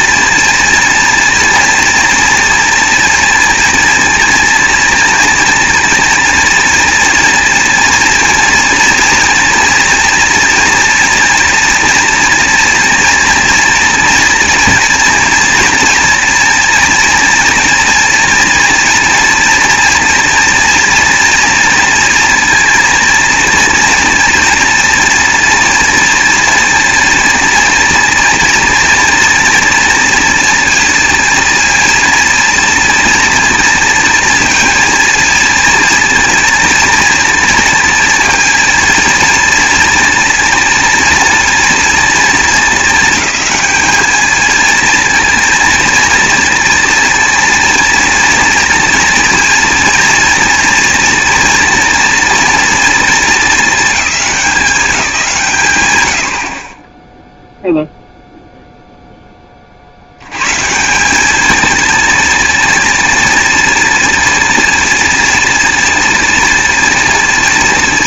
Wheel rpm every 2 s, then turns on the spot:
230, 230, 230, 230, 230, 240, 230, 240, 230, 230, 230, 230, 230, 240, 230, 230, 230, 230, 230, 230, 230, 220, 220, 230, 230, 240, 230, 200, 30, 0, 160, 230, 230, 230.
none